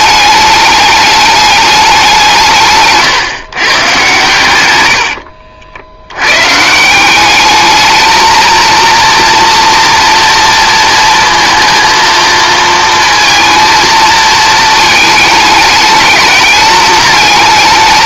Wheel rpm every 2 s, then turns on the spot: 210, 160, 110, 140, 230, 230, 230, 220, 210.
none